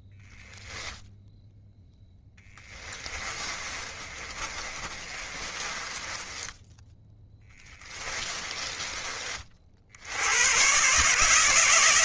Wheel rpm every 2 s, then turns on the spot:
0, 20, 30, 10, 20, 130.
2-10